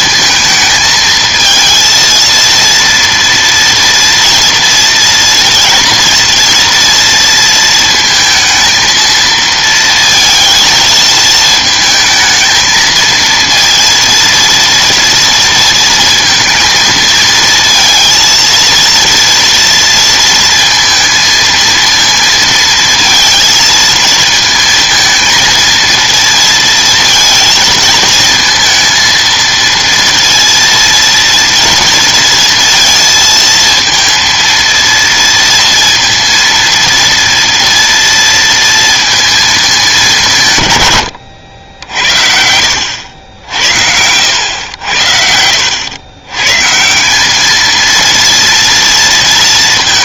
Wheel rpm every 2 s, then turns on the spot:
220, 230, 230, 230, 230, 220, 220, 230, 220, 230, 230, 230, 220, 230, 220, 230, 230, 230, 230, 230, 140, 80, 90, 140, 230.
none